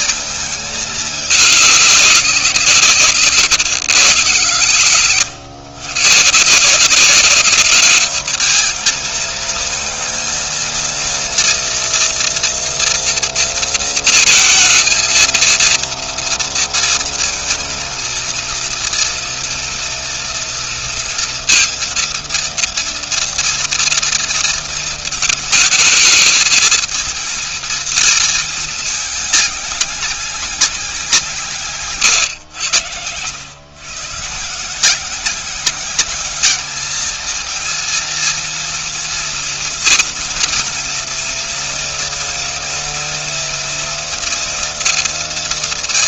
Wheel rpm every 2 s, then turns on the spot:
210, 180, 120, 160, 210, 230, 230, 230, 230, 230, 230, 230, 230, 220, 220, 200, 120, 150, 210, 230, 230, 230, 230.
none